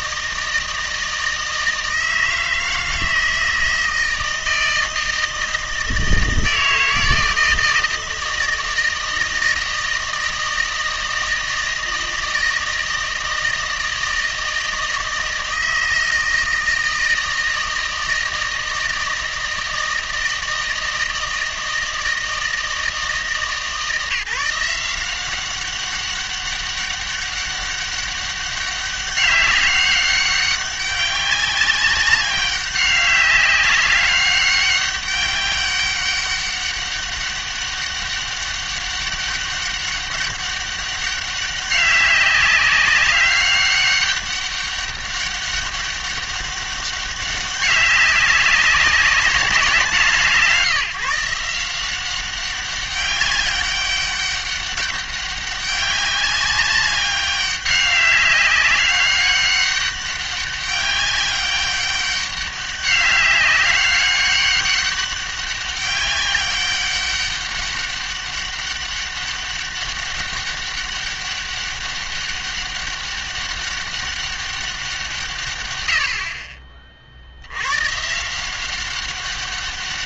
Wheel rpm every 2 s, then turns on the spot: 160, 160, 160, 160, 160, 160, 160, 160, 160, 160, 160, 160, 170, 200, 200, 200, 190, 200, 200, 200, 200, 200, 200, 200, 200, 150, 190, 200, 200, 200, 200, 200, 200, 200, 200, 200, 200, 190, 40, 190.
none